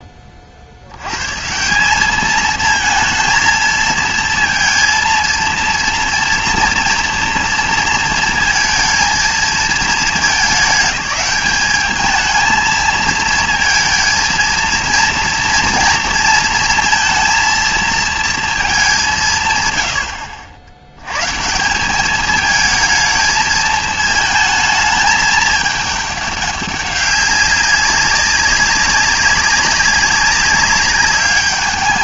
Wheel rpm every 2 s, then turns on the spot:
30, 220, 230, 230, 230, 220, 220, 230, 230, 220, 70, 210, 220, 200, 200, 190.
none